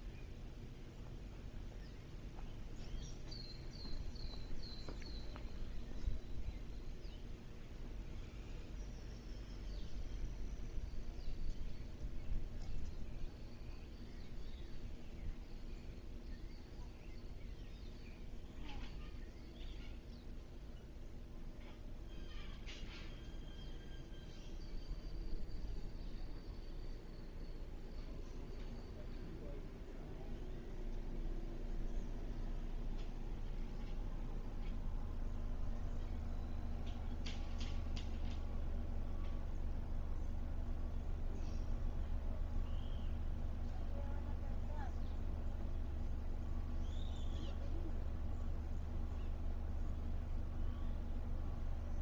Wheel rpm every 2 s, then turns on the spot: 0, 0, 0, 0, 0, 0, 0, 0, 0, 0, 0, 0, 0, 0, 0, 0, 0, 0, 0, 0, 0, 0, 0, 0, 0, 0.
none